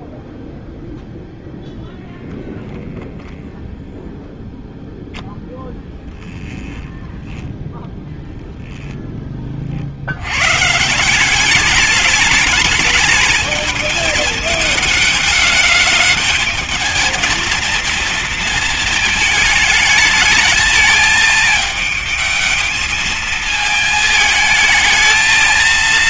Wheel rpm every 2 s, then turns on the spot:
0, 0, 0, 10, 10, 140, 210, 210, 210, 230, 210, 220, 220.
6-8